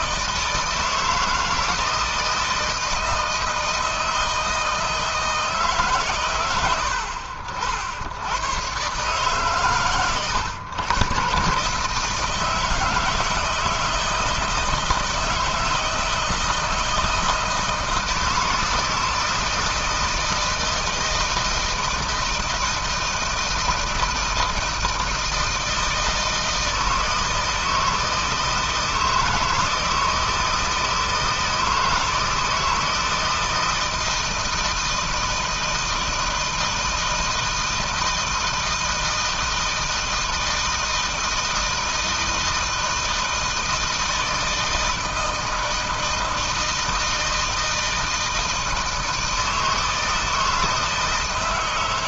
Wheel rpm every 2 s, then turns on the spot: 160, 160, 160, 80, 130, 110, 160, 160, 160, 160, 160, 160, 160, 160, 160, 160, 160, 160, 160, 160, 160, 160, 160, 160, 160, 160.
none